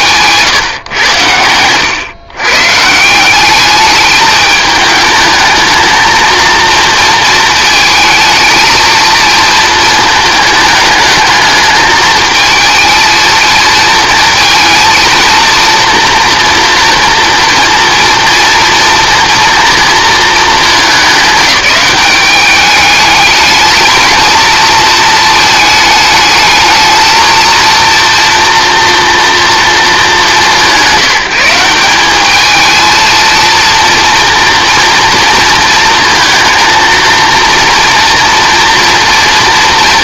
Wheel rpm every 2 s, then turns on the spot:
120, 150, 210, 230, 220, 220, 230, 230, 240, 230, 210, 210, 220, 220, 230, 180, 220, 230, 230, 230.
none